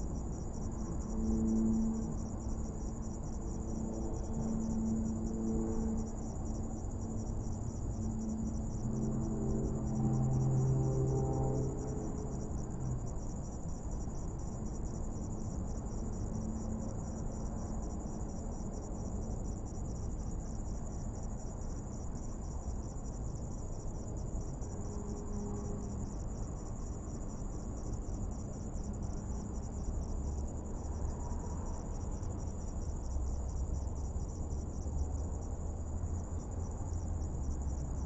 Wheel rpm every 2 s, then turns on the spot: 0, 0, 0, 0, 0, 0, 0, 0, 0, 0, 0, 0, 0, 0, 0, 0, 0, 0, 0.
none